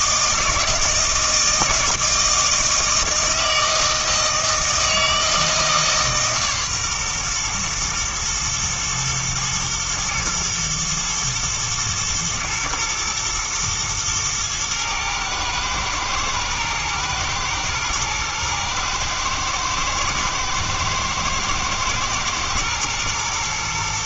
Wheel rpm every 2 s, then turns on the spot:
160, 160, 160, 140, 120, 120, 110, 110, 110, 110, 110, 110.
none